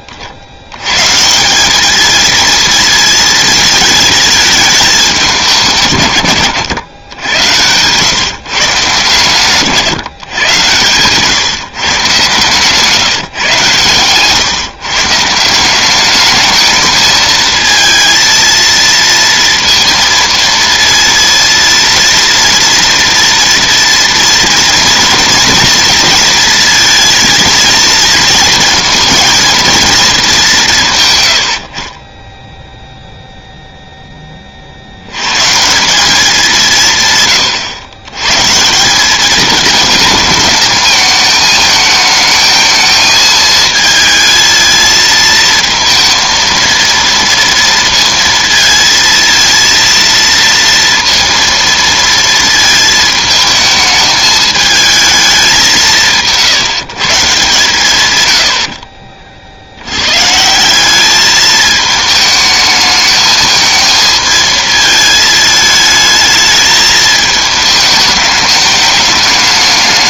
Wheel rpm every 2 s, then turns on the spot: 60, 230, 220, 110, 140, 130, 150, 130, 210, 230, 230, 240, 230, 230, 220, 180, 10, 80, 140, 190, 220, 220, 220, 230, 230, 230, 220, 220, 140, 60, 190, 220, 220, 220, 210.
12-14 58-60